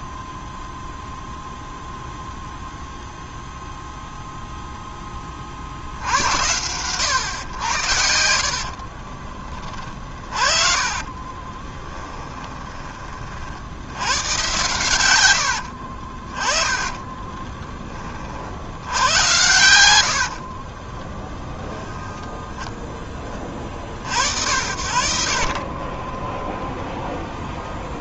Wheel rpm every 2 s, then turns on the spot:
0, 0, 10, 110, 30, 30, 30, 110, 30, 80, 20, 10, 70, 10.
8-12 16-18 20-22